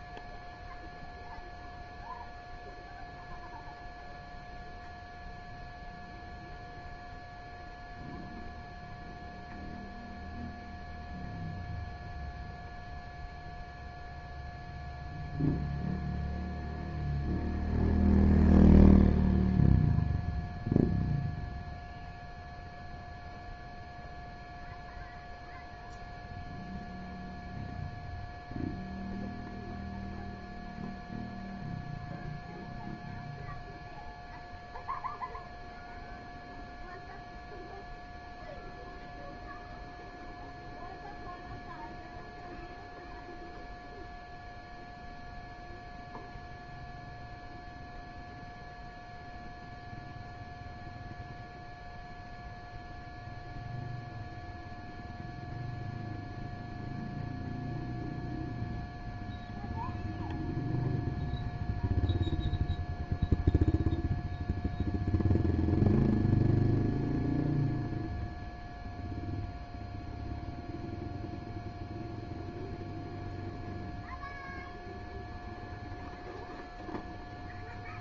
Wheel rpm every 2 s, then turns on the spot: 0, 0, 0, 0, 0, 0, 0, 0, 0, 0, 0, 0, 0, 0, 0, 0, 0, 0, 0, 0, 0, 0, 0, 0, 0, 0, 0, 0, 0, 0, 0, 0, 0, 0, 0, 0, 0, 0, 0.
none